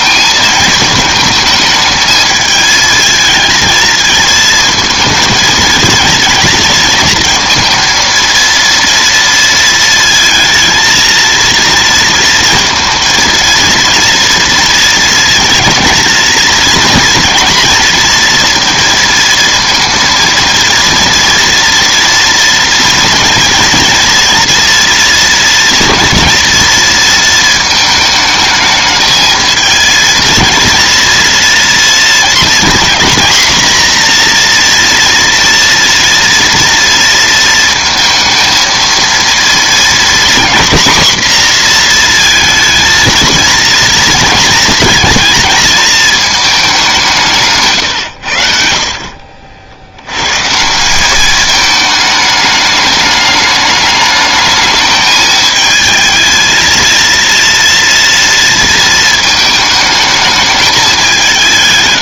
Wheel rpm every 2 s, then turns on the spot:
220, 220, 220, 220, 230, 220, 230, 230, 240, 230, 230, 230, 230, 230, 220, 230, 230, 240, 230, 230, 240, 230, 230, 200, 60, 160, 210, 210, 230, 230, 210.
none